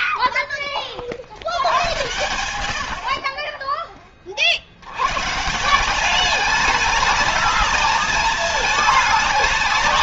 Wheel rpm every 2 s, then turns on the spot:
30, 70, 80, 210, 220.
none